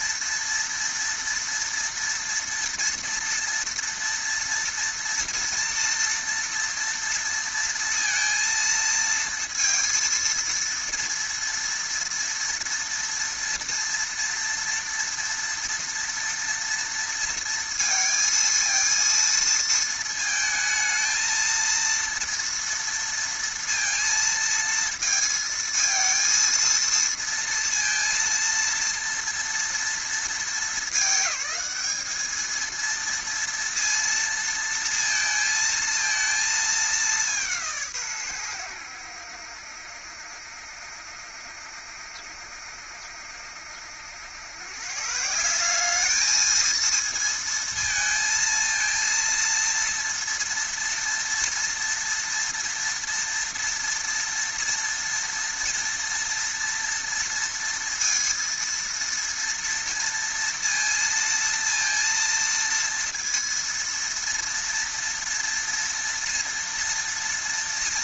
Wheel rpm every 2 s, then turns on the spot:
230, 230, 230, 230, 230, 230, 230, 230, 230, 230, 220, 230, 230, 230, 230, 220, 220, 230, 220, 100, 70, 70, 120, 220, 230, 230, 230, 230, 230, 230, 230, 230, 230, 230.
none